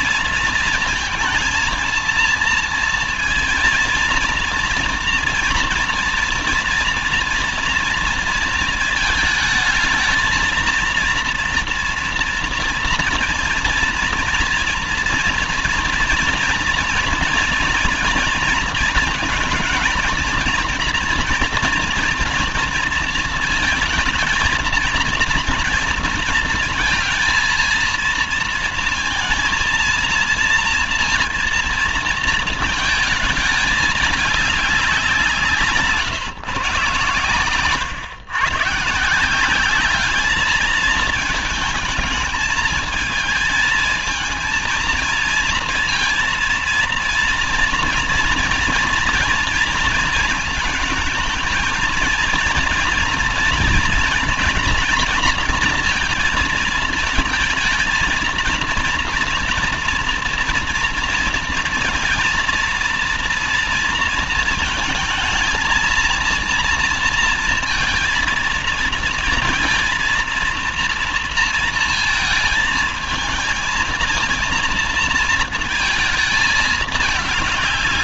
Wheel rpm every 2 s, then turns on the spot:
230, 230, 230, 230, 220, 230, 230, 230, 230, 230, 240, 230, 230, 230, 230, 230, 220, 200, 140, 150, 220, 220, 220, 230, 230, 220, 230, 230, 220, 230, 230, 240, 230, 230, 230, 230, 220, 230, 220.
none